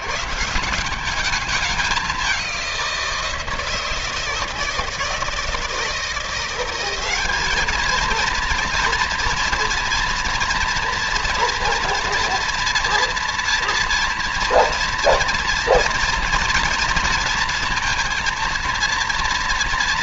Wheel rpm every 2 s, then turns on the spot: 180, 180, 160, 190, 230, 240, 230, 230, 230, 230.
none